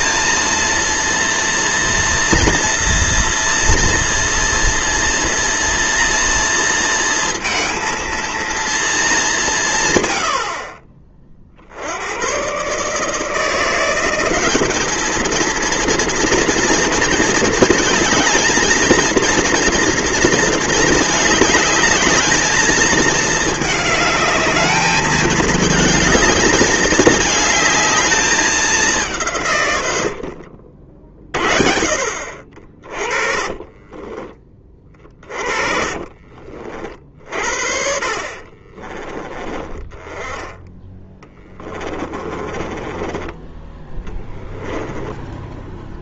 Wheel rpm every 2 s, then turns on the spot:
230, 230, 230, 230, 230, 70, 130, 200, 230, 220, 230, 220, 210, 210, 200, 50, 50, 20, 40, 40, 10, 20, 10.
30-36 38-40 42-46